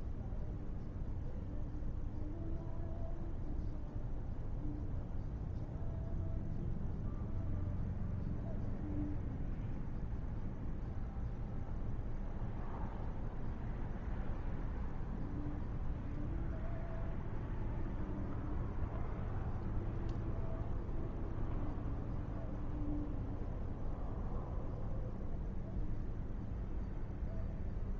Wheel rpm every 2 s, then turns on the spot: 0, 0, 0, 0, 0, 0, 0, 0, 0, 0, 0, 0, 0, 0.
none